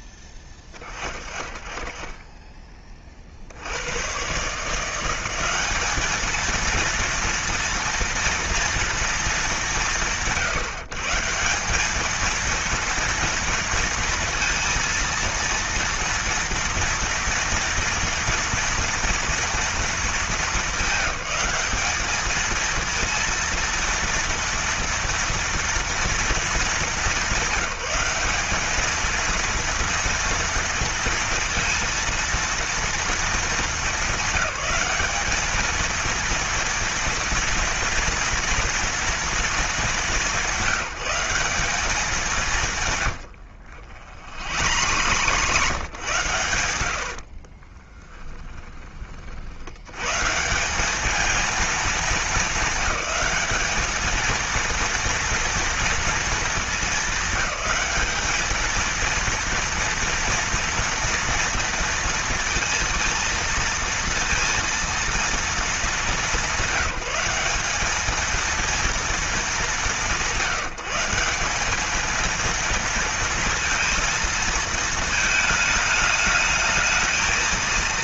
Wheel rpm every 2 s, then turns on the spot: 20, 30, 170, 230, 230, 150, 230, 230, 230, 230, 200, 230, 230, 210, 210, 230, 230, 200, 230, 230, 190, 120, 100, 80, 30, 200, 210, 230, 220, 220, 230, 230, 230, 190, 230, 170, 230, 220, 220.
44-46